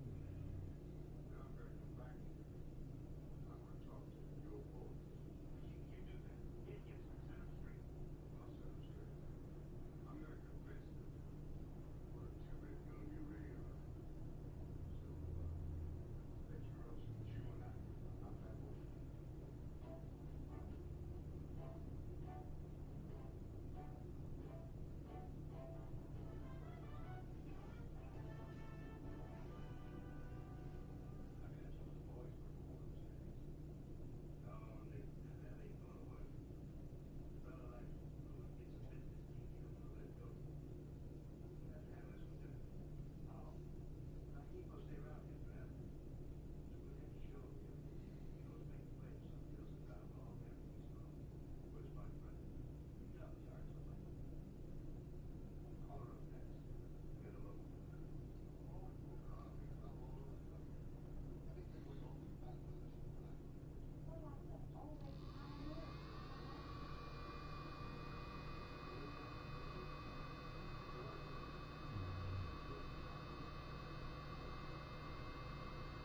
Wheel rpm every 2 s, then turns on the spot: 0, 0, 0, 0, 0, 0, 0, 0, 0, 0, 0, 0, 0, 0, 0, 0, 0, 0, 0, 0, 0, 0, 0, 0, 0, 0, 0, 0, 0, 0, 0, 0, 0, 0, 0, 0, 0, 0.
none